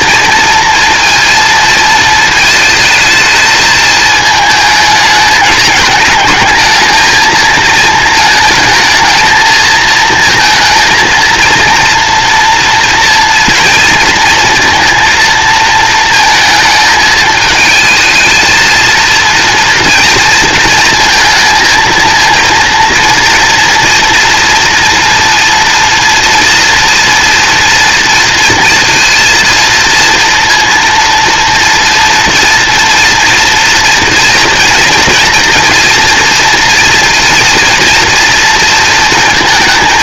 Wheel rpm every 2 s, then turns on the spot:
230, 220, 220, 220, 220, 220, 230, 230, 220, 220, 230, 230, 230, 230, 230, 230, 240, 230, 230, 230.
none